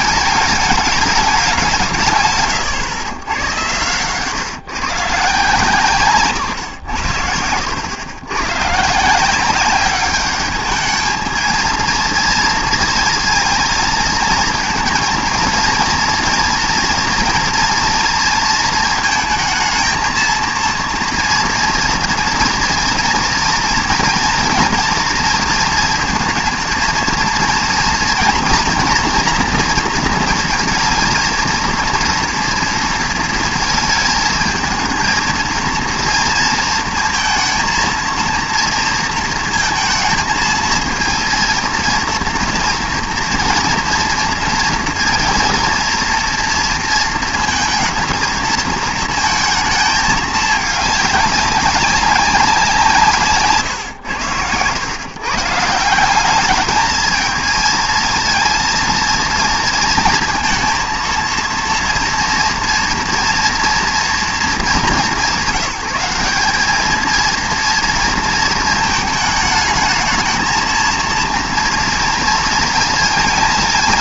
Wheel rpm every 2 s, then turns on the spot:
210, 150, 140, 100, 150, 210, 230, 230, 230, 220, 230, 230, 240, 230, 240, 220, 230, 220, 230, 230, 230, 230, 230, 230, 220, 210, 170, 110, 220, 230, 230, 230, 200, 220, 220, 230, 230.
none